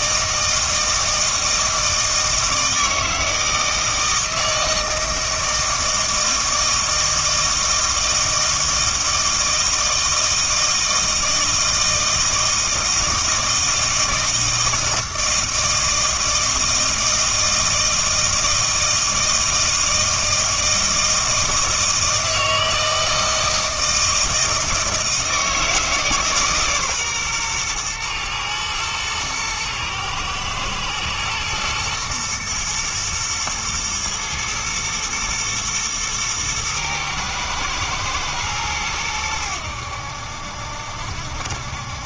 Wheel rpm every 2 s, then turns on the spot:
160, 160, 160, 160, 160, 160, 160, 160, 160, 160, 160, 160, 160, 140, 110, 110, 120, 110, 110, 110, 70.
none